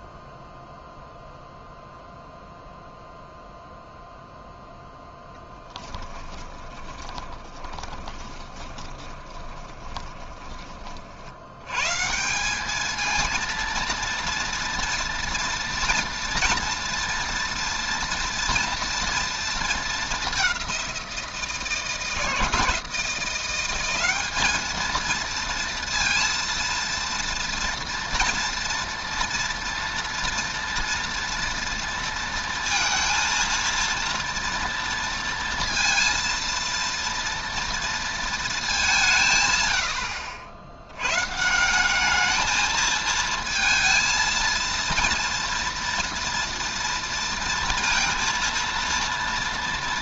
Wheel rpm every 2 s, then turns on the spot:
0, 0, 0, 20, 20, 30, 210, 230, 230, 230, 190, 160, 220, 230, 240, 230, 230, 230, 230, 200, 90, 220, 230, 230, 230.
6-10